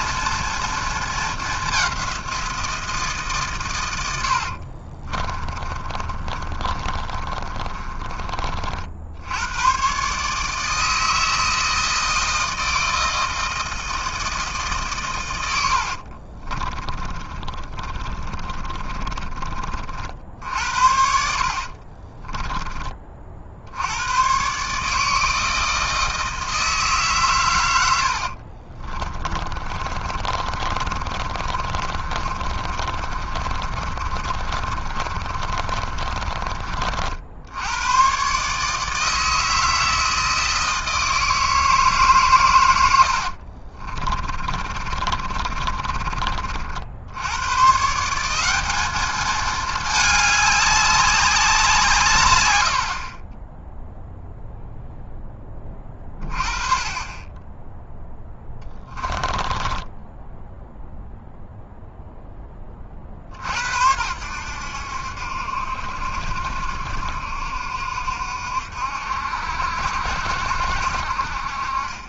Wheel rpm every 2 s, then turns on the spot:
230, 170, 60, 30, 50, 160, 160, 150, 30, 30, 70, 20, 140, 160, 40, 50, 40, 50, 50, 150, 160, 100, 30, 60, 200, 200, 70, 0, 30, 20, 0, 50, 70, 70, 70, 60.
4-8 16-20 28-36 44-46 58-60